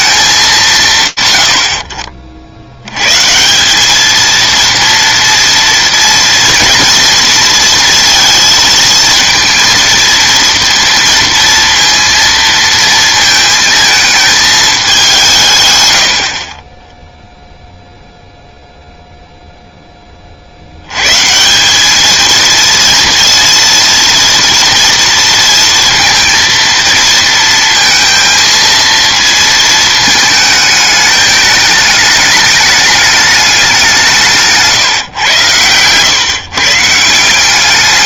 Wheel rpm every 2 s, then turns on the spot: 170, 60, 230, 230, 230, 230, 230, 220, 40, 0, 110, 230, 230, 230, 230, 210, 210, 150, 170.
none